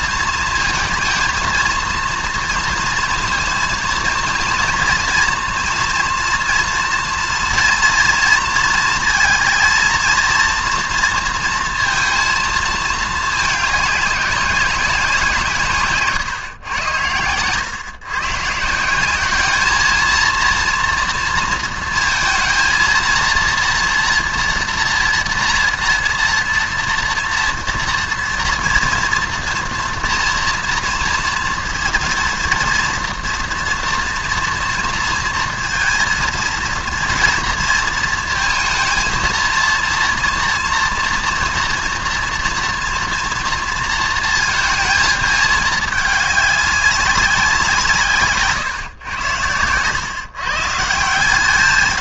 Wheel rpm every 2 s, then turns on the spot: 230, 230, 230, 230, 230, 230, 220, 190, 110, 170, 230, 230, 230, 230, 240, 230, 230, 230, 230, 230, 230, 230, 220, 190, 130, 160.
none